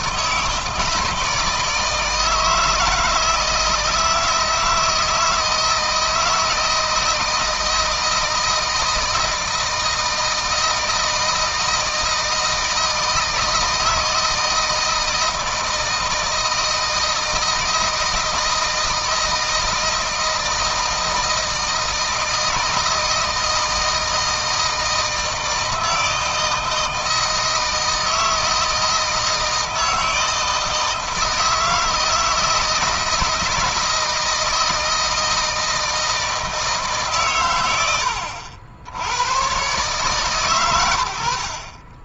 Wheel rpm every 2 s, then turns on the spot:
160, 160, 160, 160, 160, 160, 160, 160, 160, 160, 160, 160, 160, 160, 160, 160, 160, 160, 160, 80, 120.
none